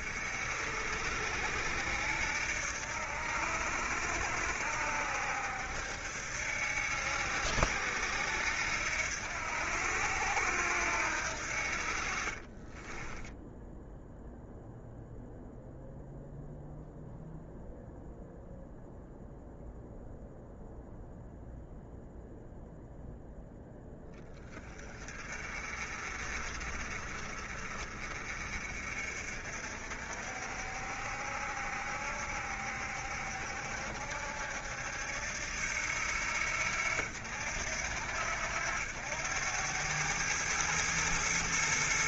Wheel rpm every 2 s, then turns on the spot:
70, 70, 70, 80, 80, 80, 10, 0, 0, 0, 0, 0, 30, 40, 50, 60, 70, 70, 70, 90, 110.
none